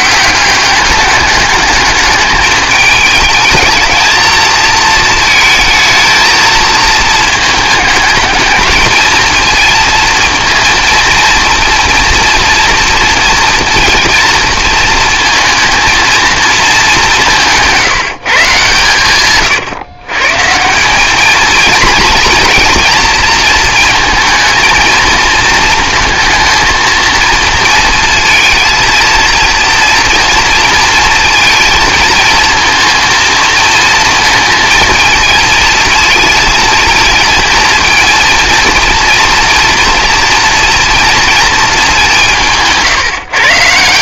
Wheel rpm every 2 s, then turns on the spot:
190, 210, 220, 220, 220, 230, 230, 230, 220, 140, 160, 240, 230, 220, 230, 230, 230, 230, 230, 230, 240, 170.
none